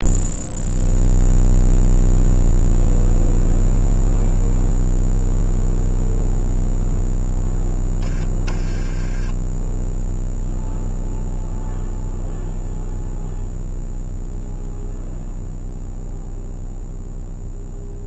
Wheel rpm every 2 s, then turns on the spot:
0, 0, 0, 0, 10, 0, 0, 0, 0.
none